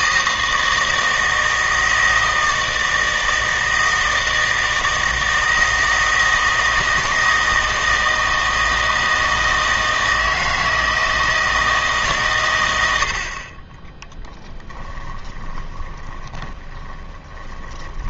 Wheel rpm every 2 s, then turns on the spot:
160, 160, 160, 160, 160, 160, 100, 10, 20.
14-18